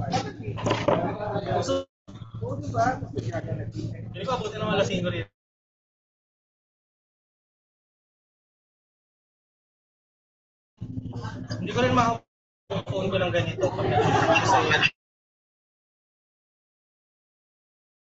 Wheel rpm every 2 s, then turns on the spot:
0, 0, 0, 0, 0, 0, 0, 0, 0.
none